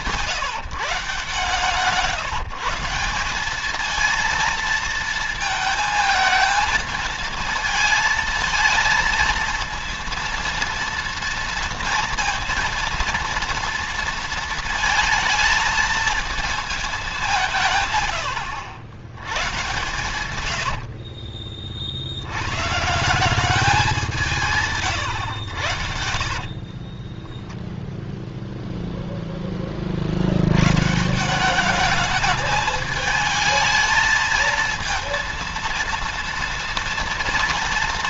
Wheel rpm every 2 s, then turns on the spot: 140, 180, 230, 230, 230, 230, 230, 230, 200, 80, 50, 170, 130, 20, 0, 140, 220, 230, 230.
20-22 26-28